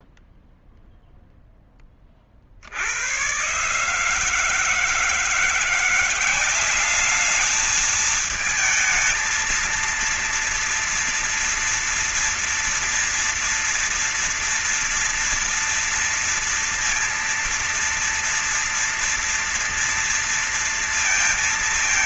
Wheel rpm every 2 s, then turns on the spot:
0, 50, 150, 190, 220, 230, 240, 230, 230, 230, 230.
none